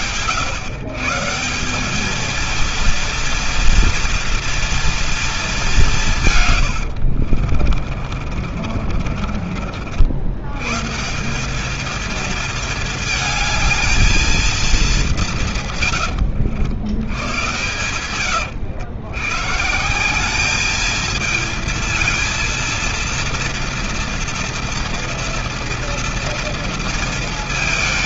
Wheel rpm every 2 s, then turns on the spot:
160, 230, 230, 80, 40, 160, 220, 210, 90, 110, 220, 230, 230, 230.
6-10